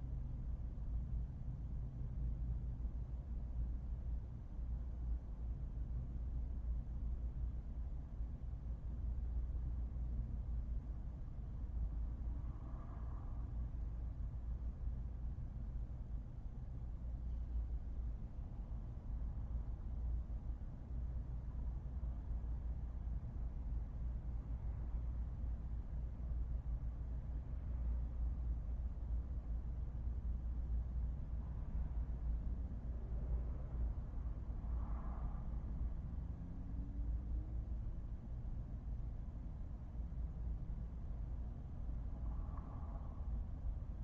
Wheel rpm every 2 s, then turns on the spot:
0, 0, 0, 0, 0, 0, 0, 0, 0, 0, 0, 0, 0, 0, 0, 0, 0, 0, 0, 0, 0, 0.
none